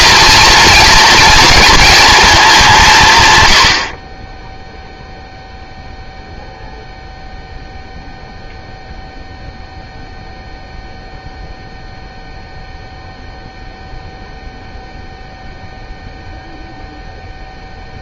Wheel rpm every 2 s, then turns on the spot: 220, 170, 0, 0, 0, 0, 0, 0, 0.
none